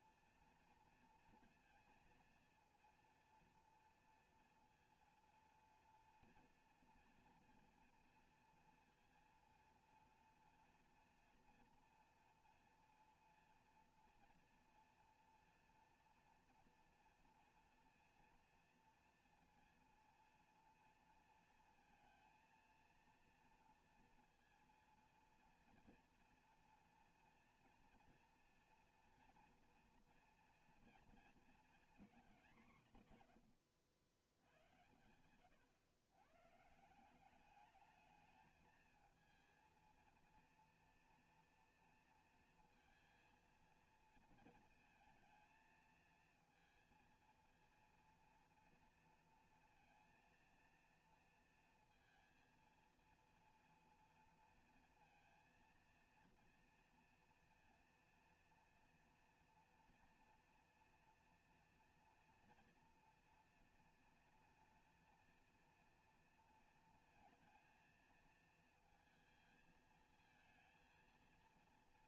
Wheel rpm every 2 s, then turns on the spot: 230, 230, 230, 230, 230, 230, 230, 230, 230, 230, 230, 230, 230, 230, 230, 230, 220, 90, 120, 210, 230, 230, 230, 230, 230, 230, 230, 230, 230, 230, 240, 230, 240, 230, 230, 220.
none